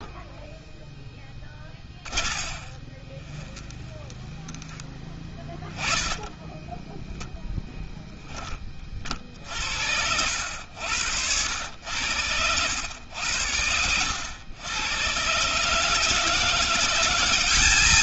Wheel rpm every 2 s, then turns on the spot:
0, 30, 10, 0, 20, 80, 100, 100, 180.
2-6